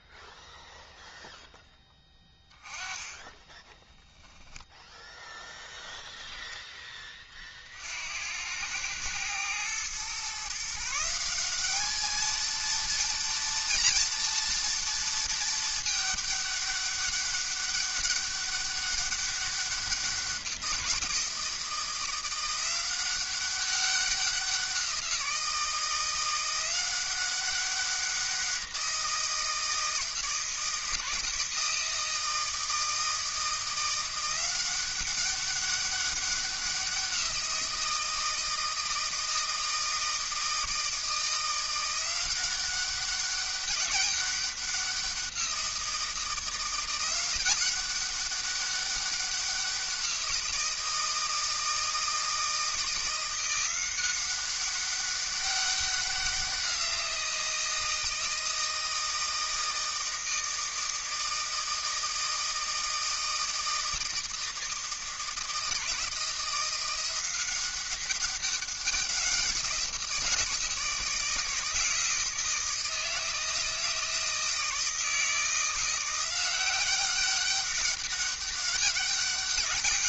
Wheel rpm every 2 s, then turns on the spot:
0, 10, 0, 10, 100, 150, 230, 230, 200, 200, 180, 180, 180, 180, 180, 160, 160, 190, 190, 160, 160, 190, 190, 170, 200, 170, 170, 190, 180, 160, 160, 160, 160, 170, 190, 160, 170, 160, 180, 200.
2-4